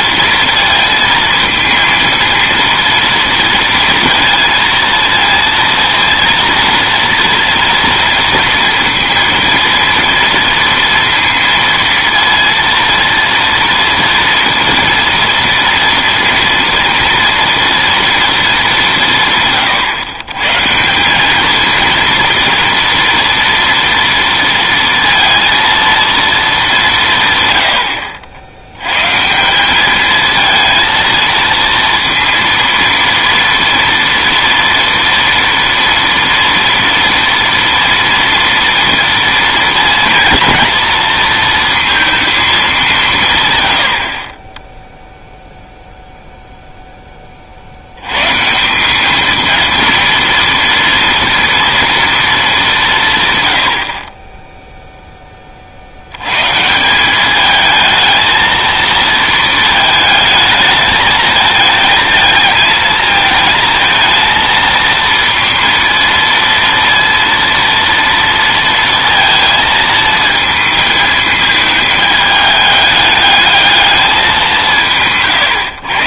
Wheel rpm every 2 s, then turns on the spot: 230, 230, 230, 230, 230, 230, 230, 230, 230, 220, 140, 240, 230, 210, 70, 220, 230, 230, 230, 230, 230, 210, 10, 0, 150, 230, 210, 10, 140, 220, 220, 220, 230, 230, 230, 220, 210, 190.
none